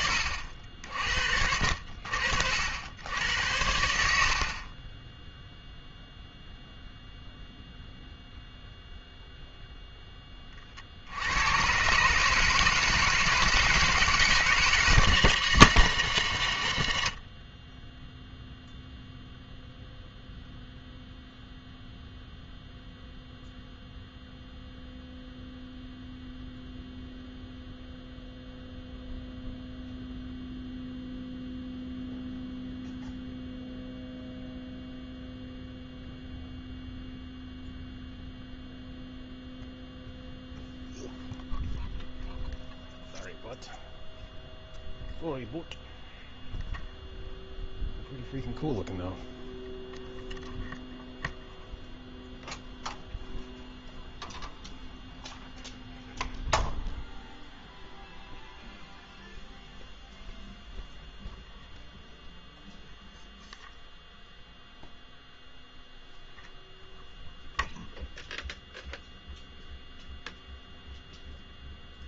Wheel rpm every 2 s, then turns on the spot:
80, 10, 0, 0, 30, 160, 160, 100, 0, 0, 0, 0, 0, 0, 0, 0, 0, 0, 0, 0, 0, 0, 0, 0, 0, 0, 0, 0, 0, 0, 0, 0, 0, 0, 0, 0.
none